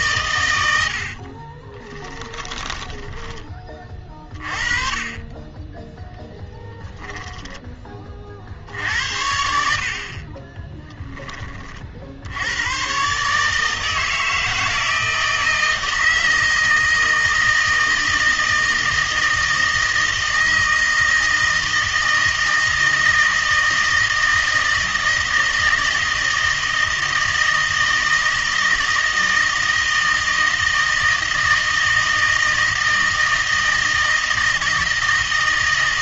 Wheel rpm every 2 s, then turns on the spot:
100, 20, 30, 0, 60, 20, 110, 160, 160, 160, 160, 160, 160, 160, 160, 160, 160, 160.
0-4 10-12